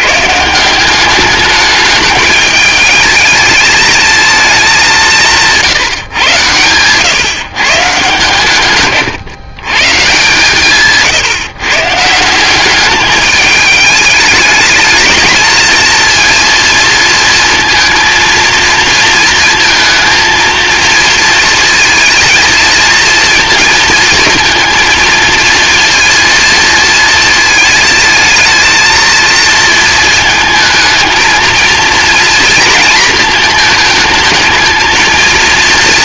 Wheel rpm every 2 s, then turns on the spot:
200, 220, 170, 140, 130, 140, 210, 220, 230, 230, 230, 230, 230, 230, 230, 230, 230, 230.
none